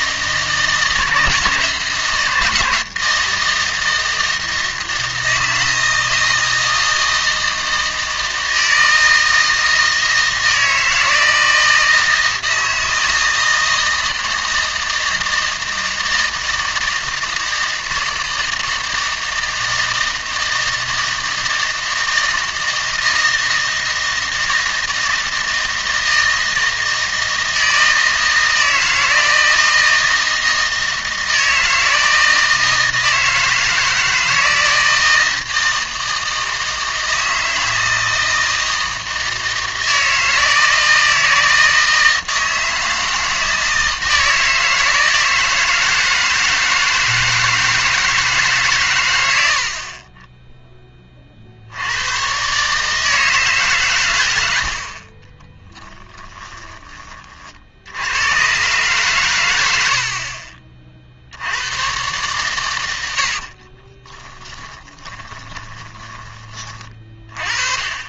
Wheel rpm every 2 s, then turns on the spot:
160, 160, 160, 160, 160, 160, 160, 160, 160, 160, 160, 160, 160, 160, 160, 160, 160, 160, 160, 160, 160, 160, 160, 160, 140, 10, 140, 60, 10, 130, 40, 120, 20, 30.
64-66